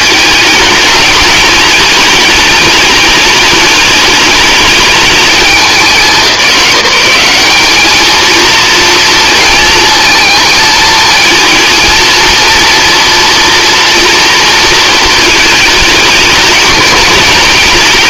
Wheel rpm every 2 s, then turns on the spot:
220, 210, 210, 190, 230, 220, 230, 230, 220.
none